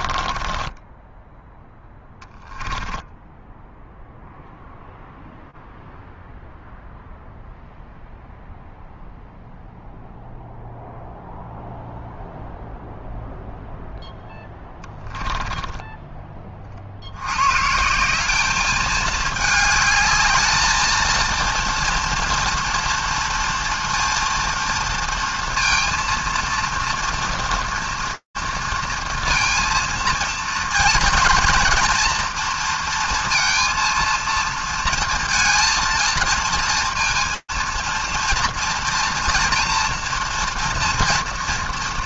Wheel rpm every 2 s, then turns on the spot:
20, 10, 0, 0, 0, 0, 0, 10, 30, 210, 220, 230, 230, 230, 230, 230, 230, 230, 230, 230, 230.
0-4 14-16